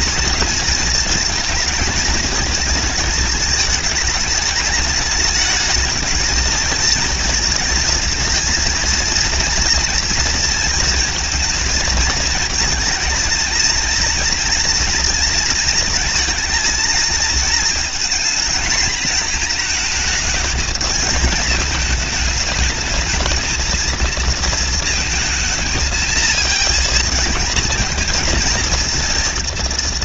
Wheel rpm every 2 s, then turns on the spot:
220, 220, 210, 220, 230, 230, 220, 230, 220, 230, 220, 210, 230, 220, 230.
none